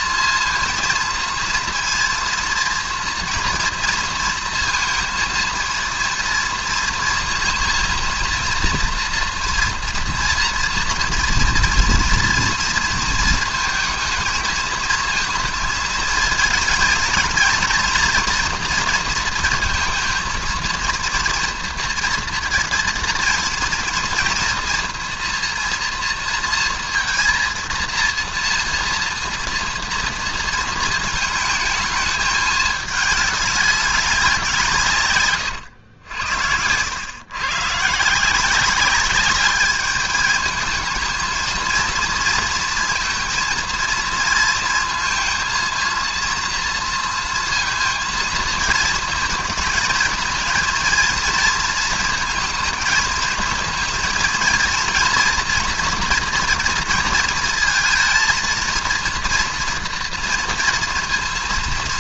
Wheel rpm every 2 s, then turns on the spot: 230, 230, 230, 230, 230, 230, 230, 220, 220, 230, 230, 230, 240, 230, 230, 230, 210, 160, 90, 190, 220, 230, 230, 230, 230, 230, 230, 230, 230, 230, 230.
none